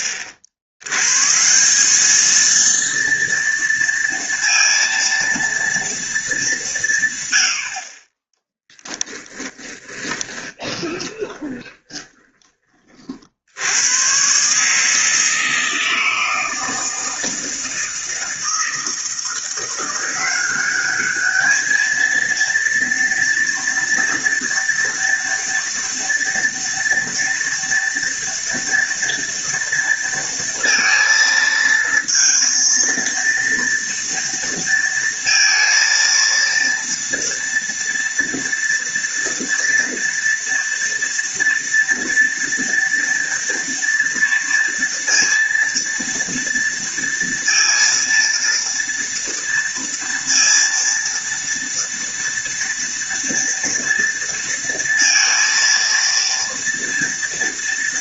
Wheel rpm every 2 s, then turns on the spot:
90, 230, 230, 160, 20, 20, 40, 150, 160, 160, 200, 230, 230, 230, 230, 230, 230, 230, 230, 230, 230, 230, 230, 230, 230, 230, 230, 230, 230.
8-12